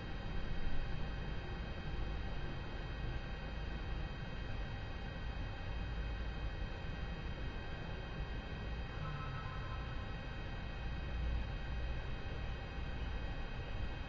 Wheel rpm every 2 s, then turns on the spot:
0, 0, 0, 0, 0, 0, 0.
none